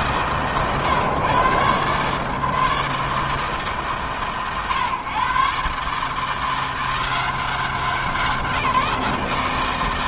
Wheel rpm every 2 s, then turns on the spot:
130, 150, 120, 170, 170.
none